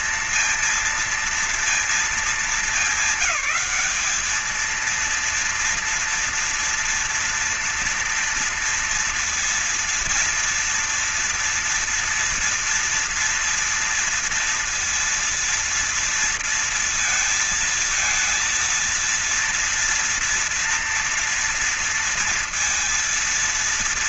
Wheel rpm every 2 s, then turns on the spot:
230, 210, 220, 240, 230, 240, 230, 230, 230, 230, 230, 230.
none